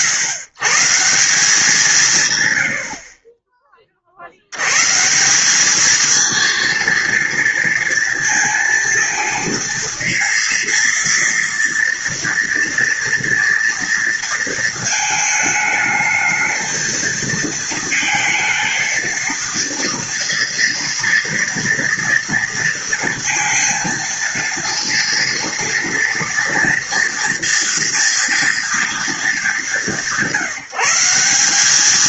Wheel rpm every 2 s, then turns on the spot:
120, 100, 100, 230, 230, 230, 230, 220, 220, 230, 230, 230, 230, 230, 230, 190.
none